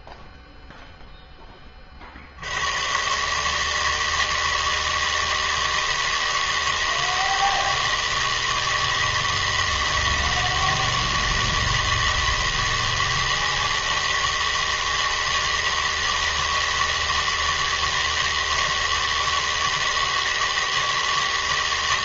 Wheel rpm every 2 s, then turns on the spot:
0, 110, 160, 160, 160, 160, 160, 160, 160, 160, 160.
none